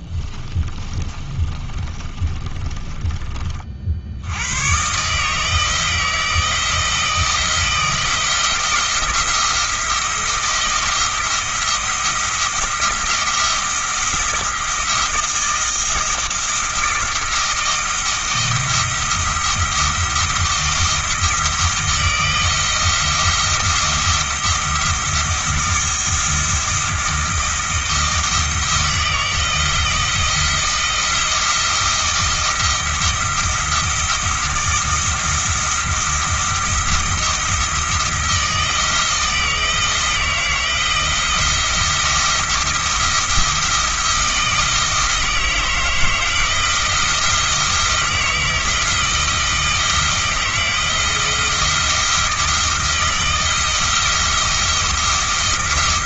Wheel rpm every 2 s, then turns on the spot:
20, 20, 120, 160, 170, 170, 170, 170, 170, 160, 170, 160, 170, 170, 160, 170, 170, 170, 170, 160, 160, 170, 160, 160, 160, 170, 170, 170.
0-4